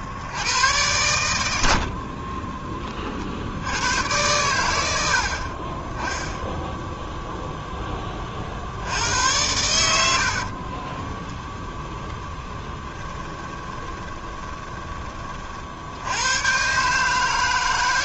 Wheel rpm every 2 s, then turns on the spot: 100, 30, 80, 0, 80, 30, 20, 20, 140.
10-14